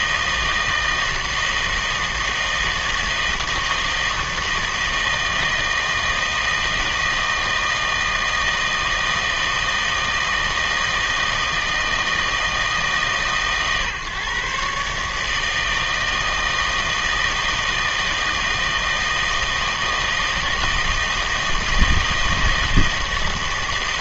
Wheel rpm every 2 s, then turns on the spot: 160, 160, 160, 160, 160, 160, 160, 140, 160, 160, 160, 160.
none